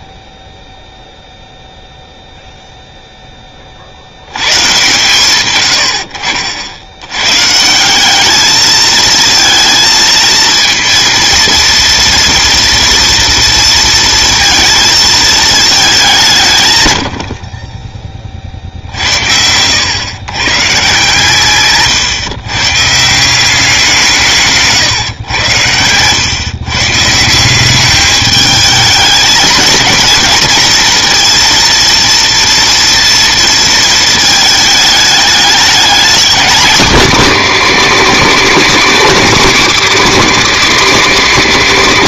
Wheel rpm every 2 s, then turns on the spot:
10, 0, 120, 60, 220, 230, 230, 230, 150, 60, 140, 140, 150, 140, 220, 220, 230, 210, 240, 260, 250.
none